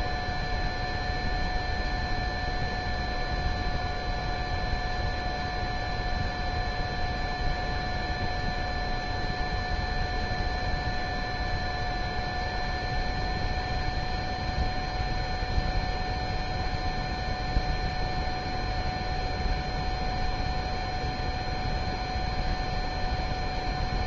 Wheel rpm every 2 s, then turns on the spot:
0, 0, 0, 0, 0, 0, 0, 0, 0, 0, 0, 0.
none